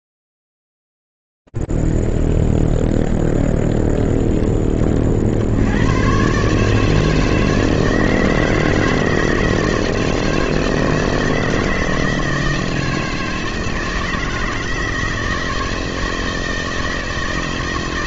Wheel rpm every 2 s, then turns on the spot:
0, 0, 0, 90, 160, 160, 160, 160, 160.
none